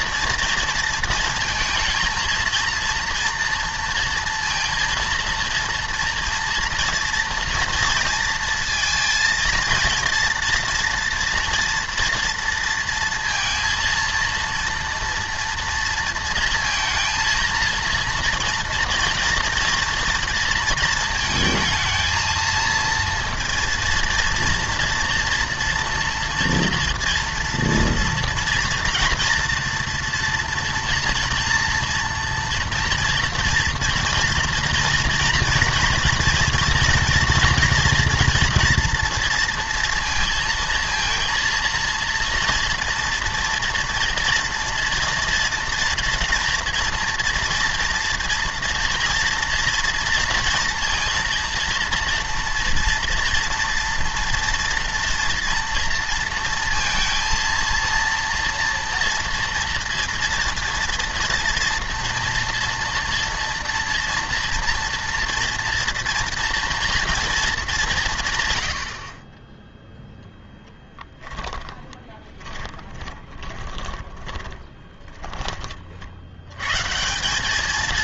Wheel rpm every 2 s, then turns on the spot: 230, 230, 230, 230, 230, 230, 230, 240, 230, 230, 230, 230, 230, 230, 240, 240, 230, 230, 230, 230, 220, 230, 230, 230, 230, 230, 230, 230, 230, 230, 230, 230, 230, 230, 100, 10, 20, 20, 140.
72-76